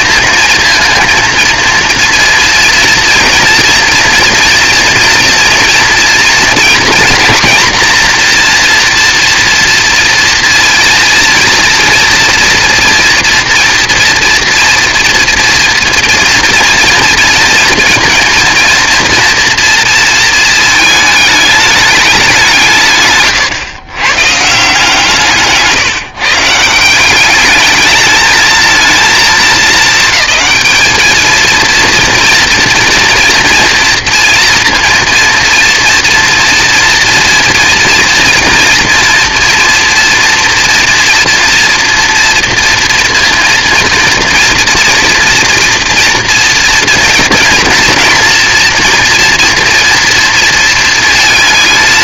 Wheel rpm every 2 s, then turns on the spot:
230, 230, 230, 230, 240, 230, 230, 230, 230, 230, 220, 160, 150, 170, 220, 220, 230, 240, 230, 230, 240, 230, 230, 240, 230, 230.
none